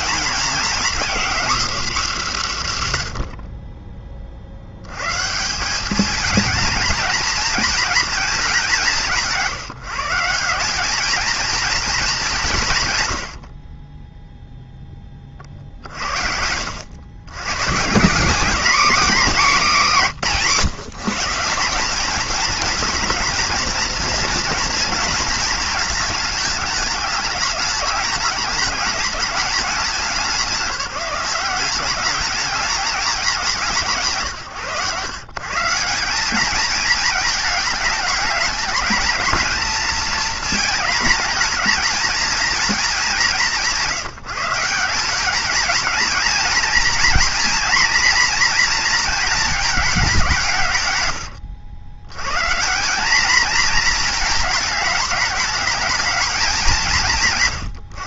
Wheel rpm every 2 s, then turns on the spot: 250, 40, 220, 220, 160, 200, 10, 50, 150, 200, 200, 230, 220, 210, 210, 180, 140, 170, 220, 220, 220, 170, 220, 240, 210, 90, 230, 220, 140.
none